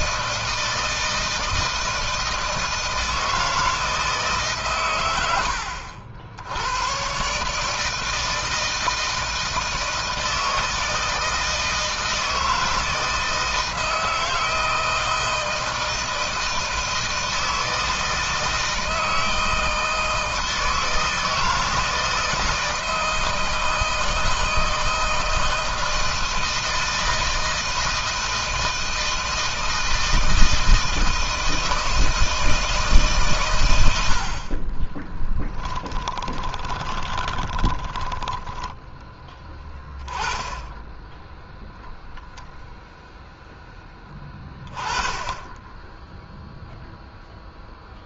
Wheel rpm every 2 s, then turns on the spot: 160, 160, 130, 90, 160, 160, 160, 160, 160, 160, 160, 160, 160, 160, 160, 160, 160, 30, 20, 10, 10, 0, 20, 0.
34-38